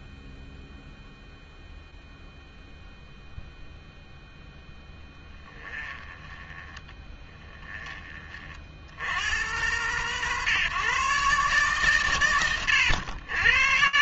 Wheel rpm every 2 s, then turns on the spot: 0, 0, 0, 20, 50, 140, 110.
6-8